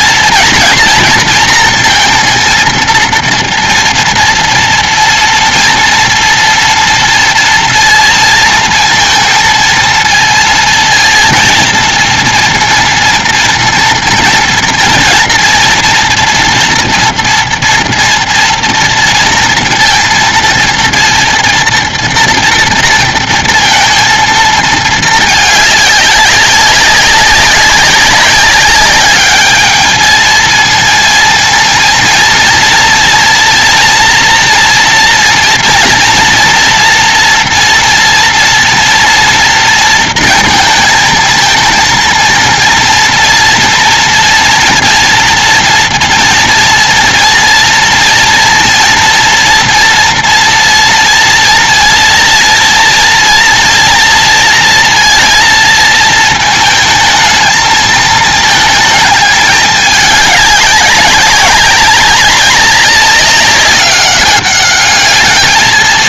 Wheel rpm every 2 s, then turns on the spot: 240, 230, 230, 230, 230, 230, 230, 230, 230, 230, 230, 240, 230, 200, 200, 220, 230, 230, 230, 230, 220, 230, 230, 230, 230, 230, 230, 230, 220, 220, 210, 190, 200.
none